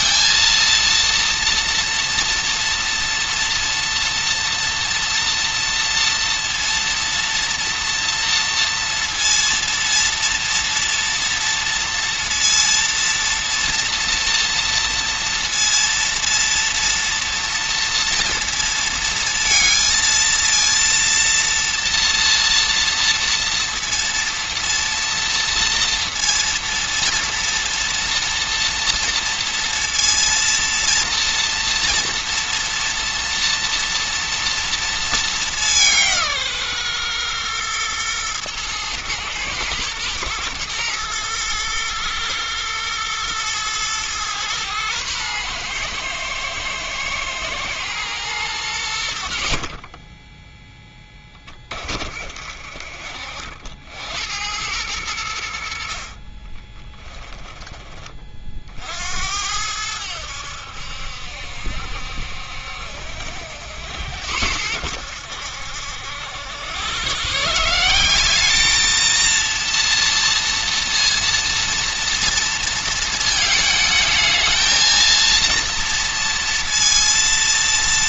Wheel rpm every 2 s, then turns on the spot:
230, 240, 240, 230, 230, 230, 230, 230, 230, 230, 230, 230, 230, 230, 230, 230, 230, 230, 120, 120, 120, 110, 120, 110, 80, 10, 50, 100, 20, 70, 70, 70, 80, 120, 220, 230, 220, 230, 230.
56-58